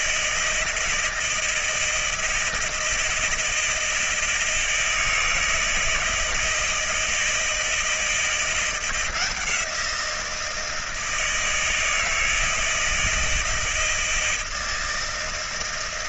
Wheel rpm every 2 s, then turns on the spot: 160, 160, 160, 160, 170, 170, 160, 160.
none